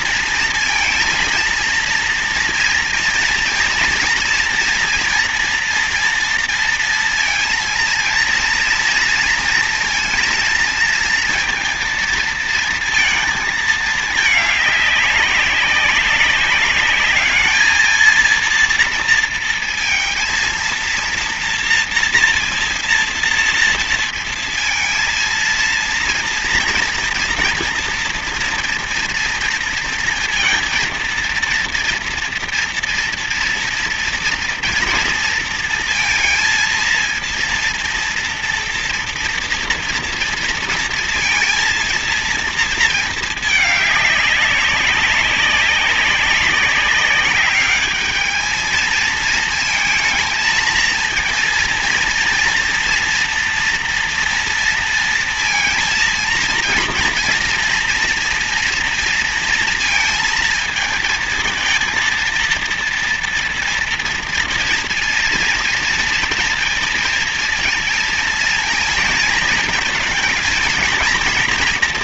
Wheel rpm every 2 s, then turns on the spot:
230, 230, 230, 230, 230, 230, 230, 210, 200, 230, 230, 230, 230, 230, 230, 230, 230, 230, 230, 230, 230, 230, 200, 200, 220, 220, 230, 230, 230, 230, 230, 230, 230, 230, 230, 230.
none